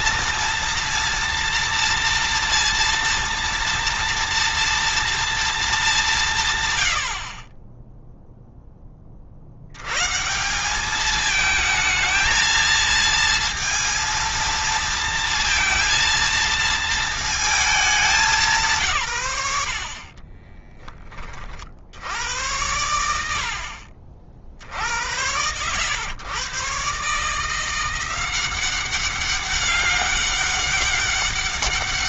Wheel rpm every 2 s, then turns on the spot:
230, 230, 230, 120, 20, 190, 230, 230, 230, 150, 30, 90, 70, 130, 190, 200.
none